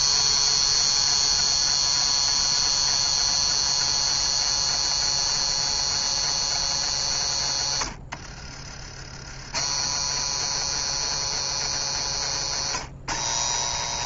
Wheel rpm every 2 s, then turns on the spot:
250, 250, 250, 200, 130, 250, 210.
none